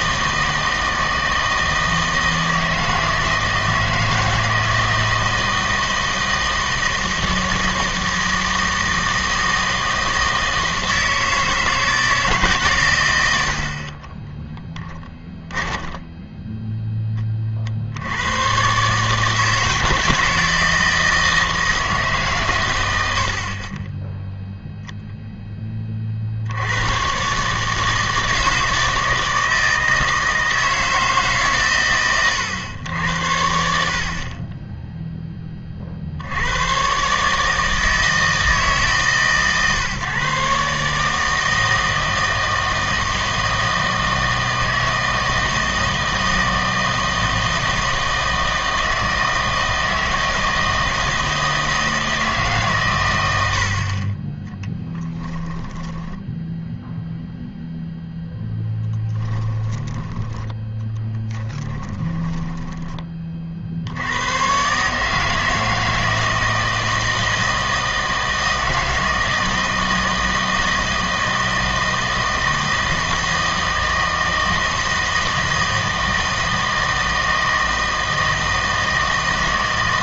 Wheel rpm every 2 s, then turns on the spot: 160, 160, 160, 160, 160, 160, 140, 10, 10, 130, 160, 110, 0, 90, 160, 160, 110, 20, 110, 150, 140, 160, 160, 160, 160, 160, 130, 10, 0, 10, 10, 20, 130, 160, 160, 160, 160, 160, 160, 160.
14-16 54-56 58-60 62-64